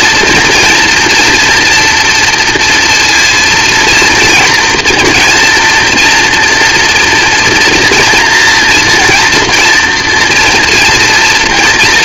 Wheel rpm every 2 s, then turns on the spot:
240, 230, 230, 240, 230, 230.
none